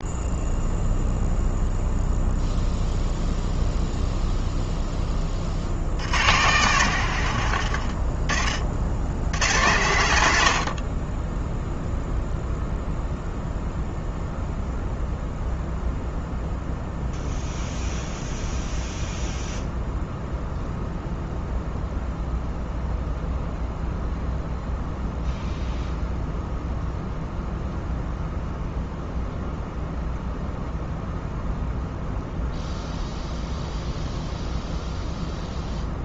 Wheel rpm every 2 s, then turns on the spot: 0, 0, 10, 100, 70, 20, 0, 0, 0, 0, 0, 0, 0, 0, 0, 0, 0, 0.
none